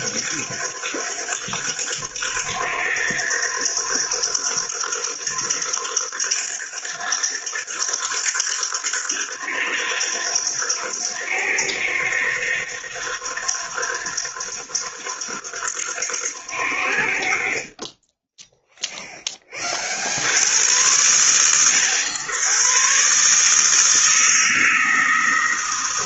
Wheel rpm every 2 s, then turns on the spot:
90, 90, 90, 90, 90, 90, 90, 90, 70, 0, 90, 120, 160.
none